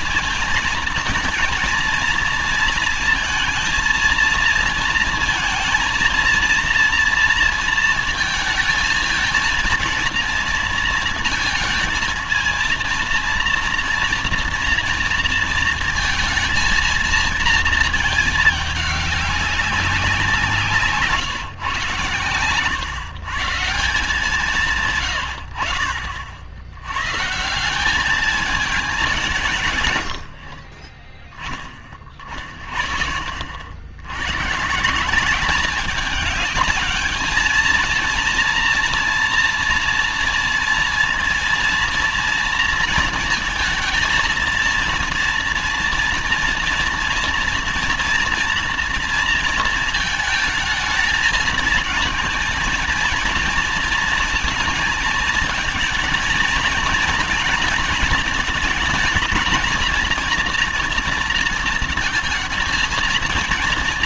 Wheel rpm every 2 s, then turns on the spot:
220, 230, 230, 230, 220, 230, 230, 230, 230, 210, 180, 120, 180, 80, 210, 60, 40, 130, 210, 230, 230, 230, 230, 230, 230, 220, 230, 220, 230, 220, 230, 230.
none